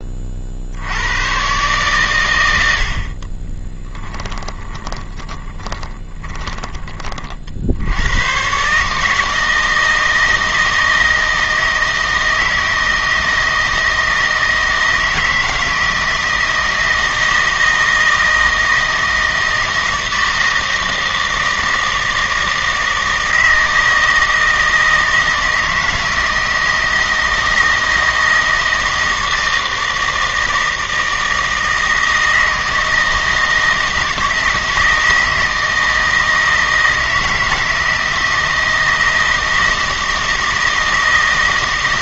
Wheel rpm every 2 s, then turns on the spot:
70, 70, 20, 20, 140, 160, 160, 160, 170, 160, 160, 160, 160, 160, 160, 160, 160, 160, 160, 160, 160.
4-6